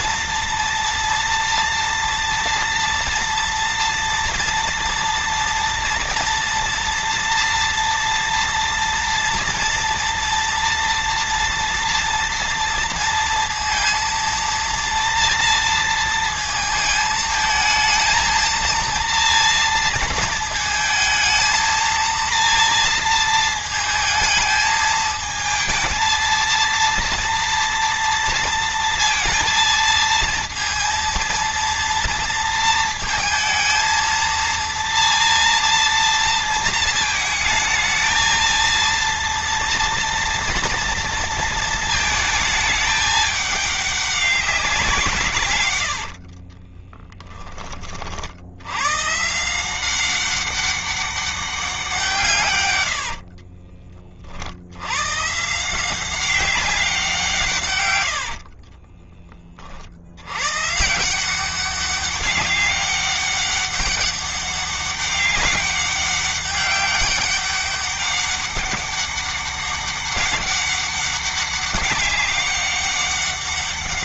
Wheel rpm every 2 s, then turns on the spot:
230, 230, 230, 240, 230, 230, 230, 230, 220, 230, 230, 230, 220, 230, 230, 230, 230, 230, 230, 230, 230, 220, 190, 30, 90, 200, 120, 80, 190, 40, 120, 200, 200, 200, 200, 200, 200.
46-48 52-54 58-60